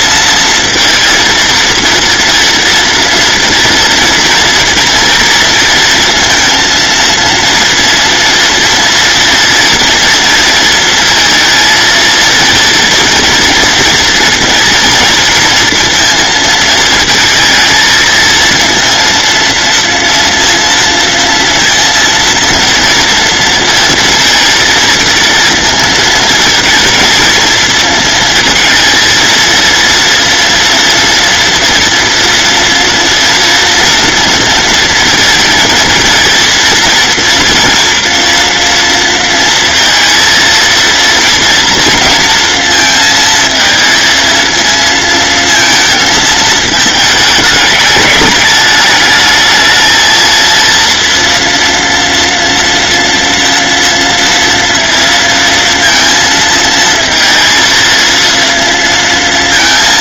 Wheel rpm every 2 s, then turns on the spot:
230, 230, 230, 230, 230, 230, 230, 230, 220, 230, 230, 230, 230, 220, 220, 230, 240, 230, 230, 230, 230, 230, 230, 220, 210, 230, 230, 230, 230, 230.
none